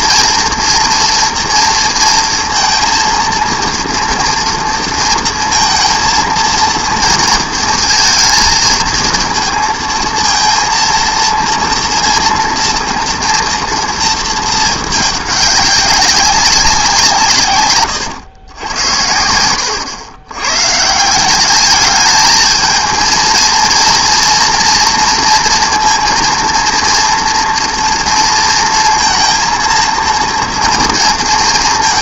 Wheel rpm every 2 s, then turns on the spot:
230, 230, 230, 230, 230, 230, 230, 210, 190, 100, 130, 220, 240, 230, 230, 230.
none